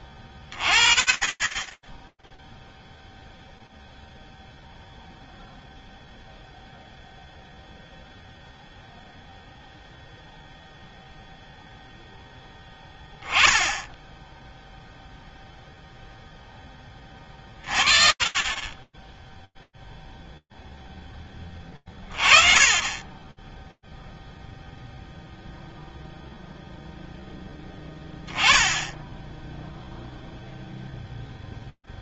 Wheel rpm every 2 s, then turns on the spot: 10, 10, 0, 0, 0, 0, 10, 0, 30, 0, 30, 0, 0, 0, 0, 70.
none